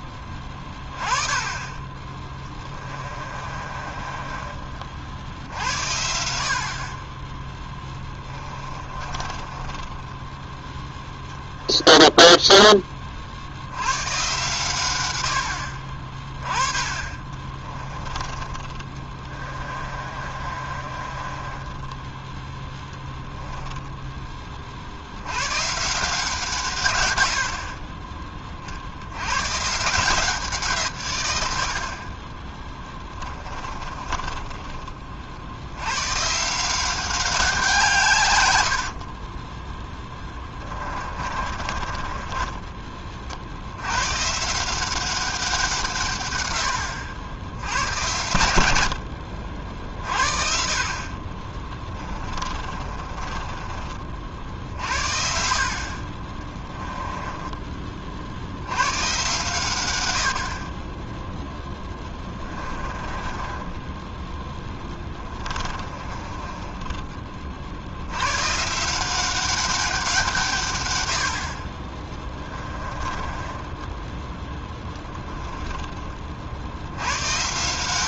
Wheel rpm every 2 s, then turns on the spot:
20, 30, 60, 30, 30, 0, 30, 100, 30, 30, 30, 10, 50, 130, 60, 150, 20, 20, 180, 70, 20, 20, 170, 100, 80, 50, 30, 60, 20, 90, 40, 20, 10, 20, 160, 110, 20, 10, 70.
2-4 8-10 18-22 32-34 38-42 52-54 56-58 62-68 72-76